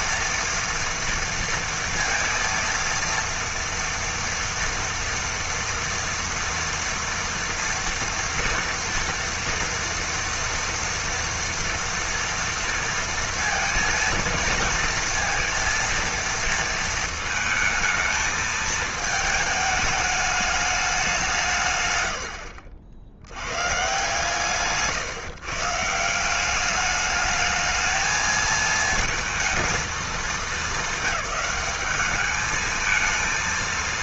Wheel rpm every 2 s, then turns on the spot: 240, 230, 240, 230, 230, 230, 230, 230, 230, 220, 200, 70, 140, 200, 230, 210, 220.
none